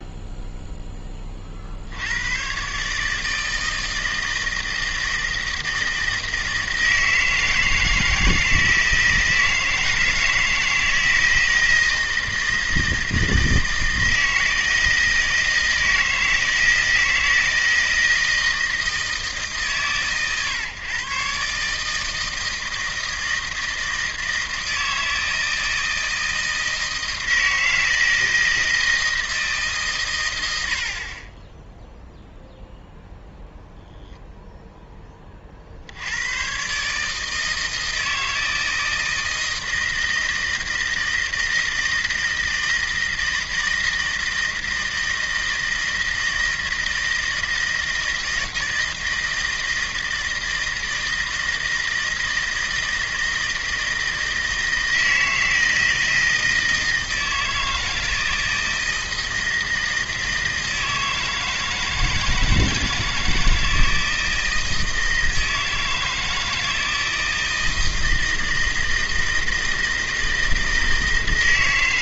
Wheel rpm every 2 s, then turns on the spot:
0, 140, 160, 160, 160, 160, 160, 160, 160, 160, 130, 160, 160, 160, 160, 70, 0, 0, 130, 160, 160, 160, 160, 160, 160, 160, 160, 160, 160, 160, 160, 160, 160, 160, 160, 160.
none